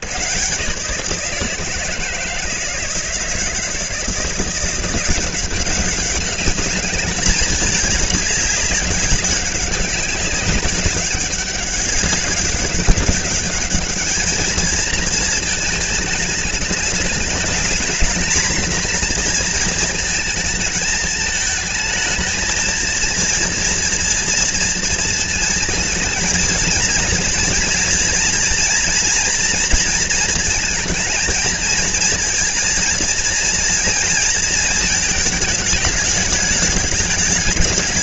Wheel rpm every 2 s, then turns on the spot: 140, 160, 180, 200, 200, 190, 200, 220, 210, 230, 220, 230, 230, 230, 230, 220, 230, 220, 210.
none